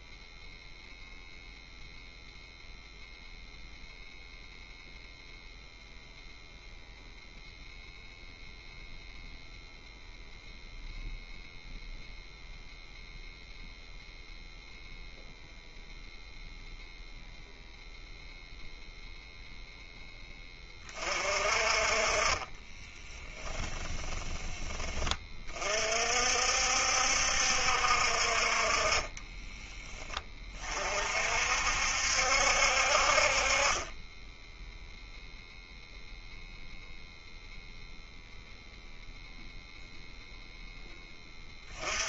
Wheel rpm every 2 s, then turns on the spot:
0, 0, 0, 0, 0, 0, 0, 0, 0, 0, 30, 20, 20, 60, 30, 40, 50, 0, 0, 0, 10.
22-24